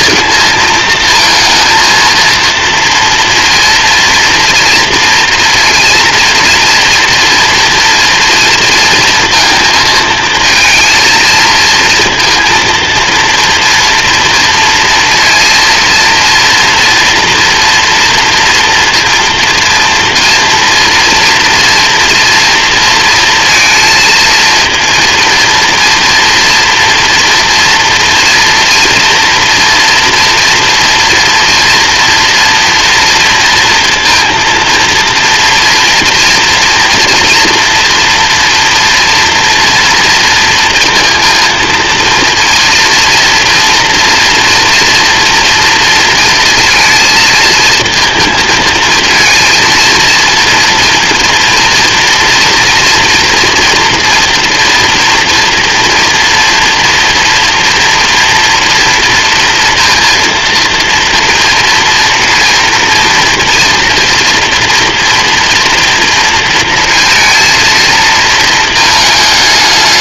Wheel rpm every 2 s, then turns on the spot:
230, 230, 230, 230, 230, 230, 230, 230, 230, 230, 240, 230, 230, 230, 230, 240, 230, 230, 240, 240, 230, 240, 230, 230, 230, 230, 230, 230, 230, 230, 230, 230, 230, 230, 220.
none